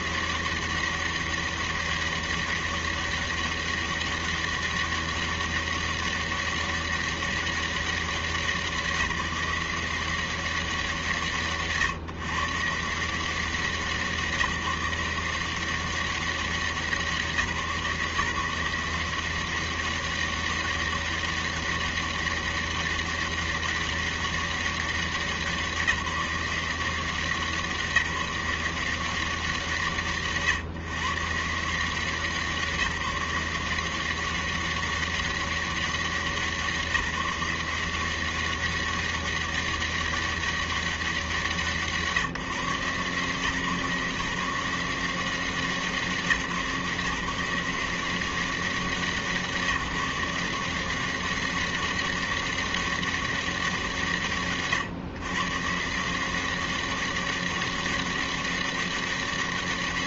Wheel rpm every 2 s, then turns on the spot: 180, 200, 200, 200, 190, 180, 130, 170, 190, 150, 200, 200, 200, 180, 170, 130, 160, 180, 180, 180, 200, 160, 150, 160, 170, 170, 200, 150, 160, 200.
none